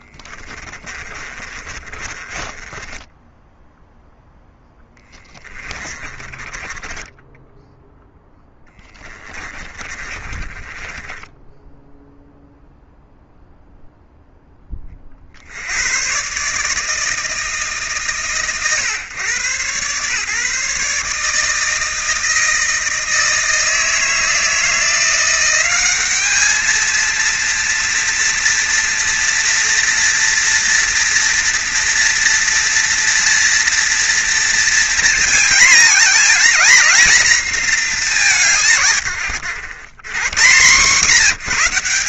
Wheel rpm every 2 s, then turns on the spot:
30, 20, 10, 20, 10, 20, 0, 20, 150, 130, 140, 160, 170, 220, 230, 230, 230, 230, 230, 130, 170.
0-12